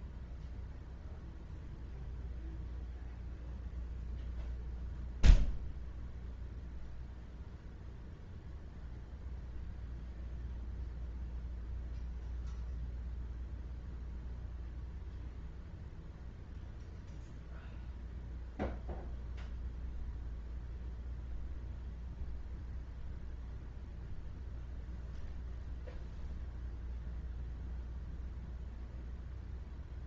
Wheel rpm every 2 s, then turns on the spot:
0, 0, 0, 0, 0, 0, 0, 0, 0, 0, 0, 0, 0, 0, 0.
none